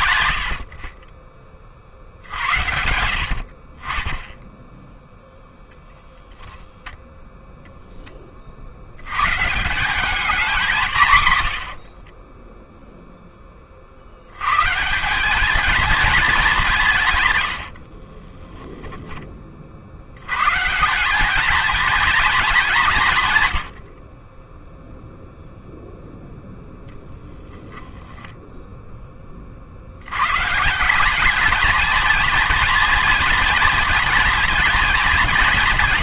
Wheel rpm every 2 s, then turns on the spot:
50, 80, 10, 0, 30, 170, 10, 130, 180, 10, 140, 210, 0, 0, 0, 150, 230, 230.
0-2 12-14 18-20